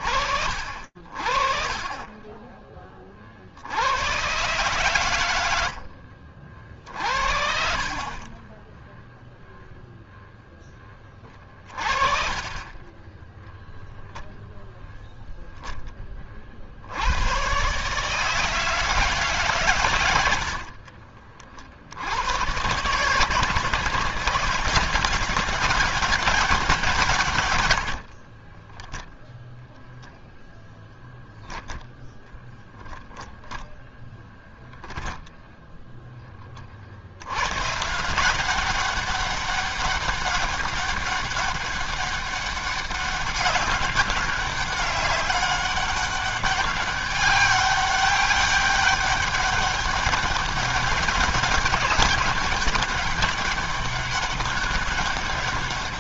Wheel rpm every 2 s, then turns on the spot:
30, 120, 30, 40, 0, 30, 0, 0, 100, 150, 60, 160, 190, 140, 0, 0, 0, 0, 90, 200, 200, 190, 190, 200, 200, 200, 200, 200.
26-28